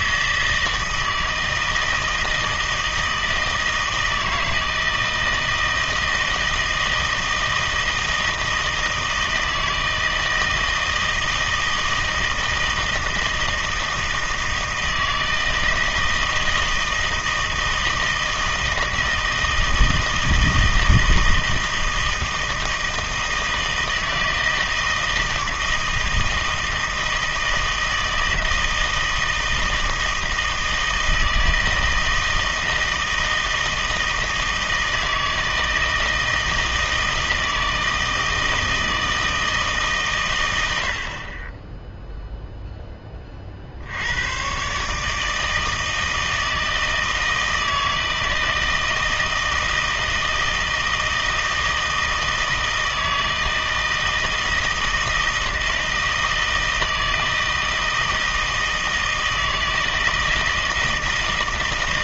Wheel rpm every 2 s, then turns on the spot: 160, 160, 160, 160, 160, 160, 160, 160, 160, 160, 160, 160, 160, 160, 160, 160, 160, 160, 160, 160, 90, 0, 130, 160, 160, 160, 160, 160, 160, 160, 160.
none